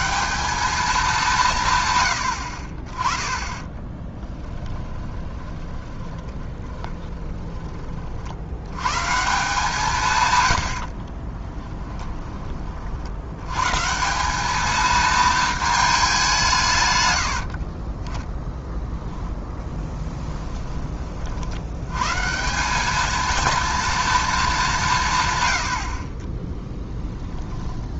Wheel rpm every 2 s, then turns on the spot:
200, 30, 10, 20, 120, 60, 50, 220, 140, 0, 20, 200, 180, 10.
4-8 10-12